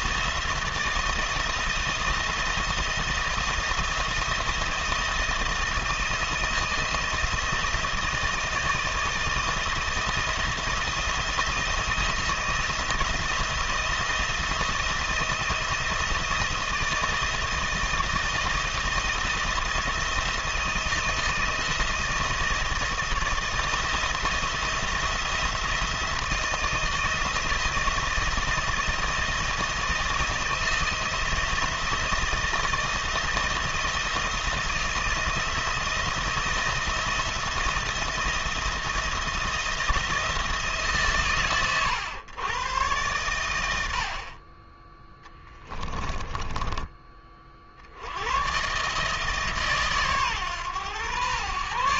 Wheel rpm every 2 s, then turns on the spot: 170, 170, 170, 160, 160, 170, 170, 170, 160, 160, 160, 160, 170, 160, 170, 170, 160, 170, 170, 170, 140, 110, 10, 40, 150, 120.
none